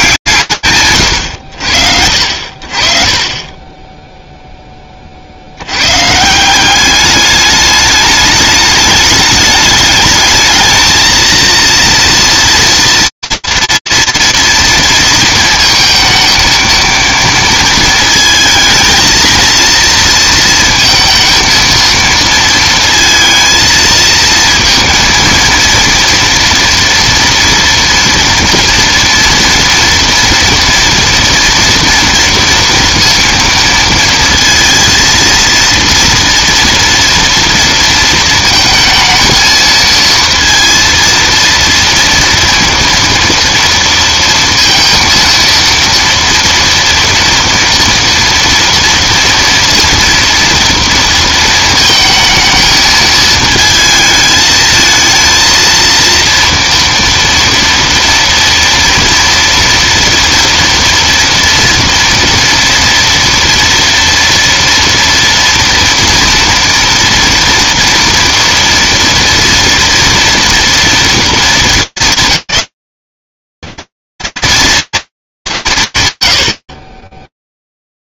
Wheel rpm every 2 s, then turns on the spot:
130, 60, 30, 200, 210, 220, 230, 230, 230, 220, 230, 230, 230, 230, 230, 230, 230, 230, 230, 220, 230, 230, 230, 230, 240, 230, 220, 220, 230, 230, 230, 230, 230, 230, 230, 230, 220, 230, 110.
none